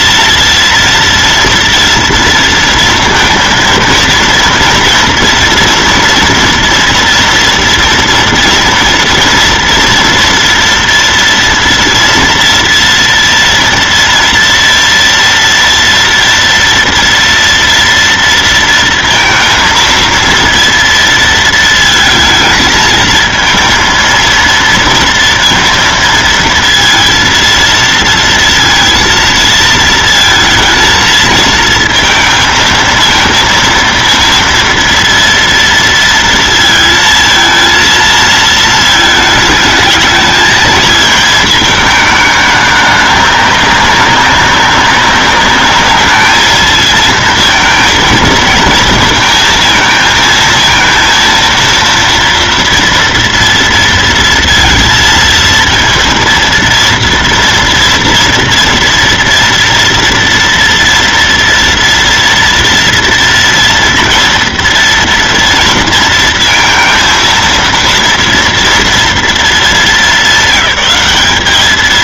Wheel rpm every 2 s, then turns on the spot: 230, 230, 230, 230, 230, 230, 230, 230, 230, 230, 230, 220, 230, 230, 230, 230, 230, 230, 230, 230, 220, 210, 190, 220, 230, 230, 230, 230, 230, 230, 230, 230, 230, 230, 230, 200.
none